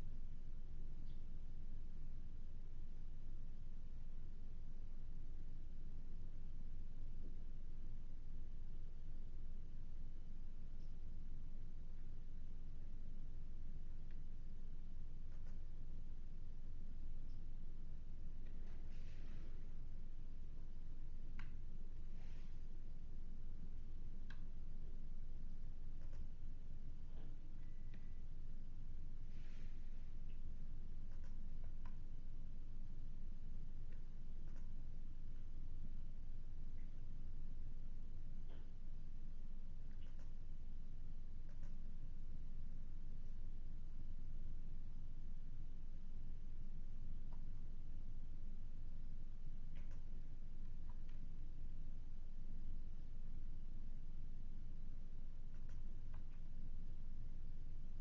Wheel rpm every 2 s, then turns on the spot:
0, 0, 0, 0, 0, 0, 0, 0, 0, 0, 0, 0, 0, 0, 0, 0, 0, 0, 0, 0, 0, 0, 0, 0, 0, 0, 0, 0, 0.
none